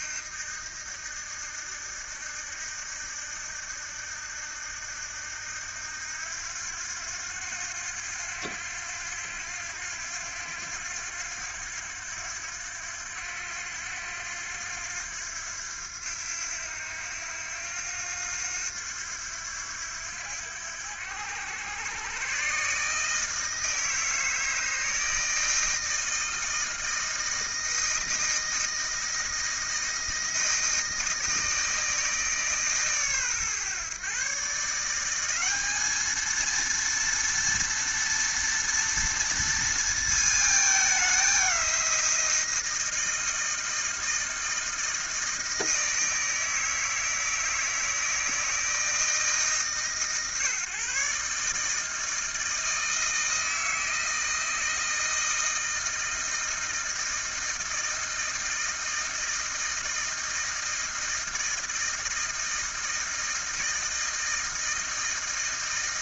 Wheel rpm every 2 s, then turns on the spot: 80, 80, 80, 90, 90, 90, 90, 90, 90, 90, 90, 140, 160, 160, 160, 160, 150, 140, 230, 230, 220, 170, 160, 160, 160, 140, 160, 160, 160, 160, 160, 160, 160.
none